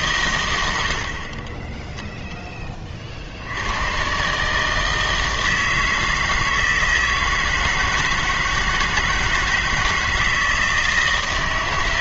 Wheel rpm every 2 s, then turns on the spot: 80, 20, 150, 160, 160, 160.
none